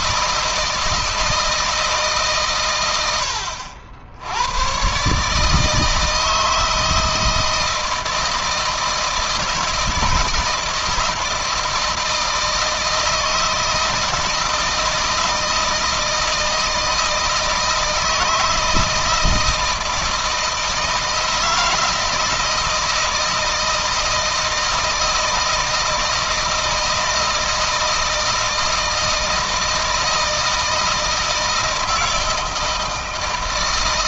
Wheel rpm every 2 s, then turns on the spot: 160, 110, 110, 160, 160, 160, 160, 160, 160, 160, 160, 160, 160, 160, 160, 160, 160.
none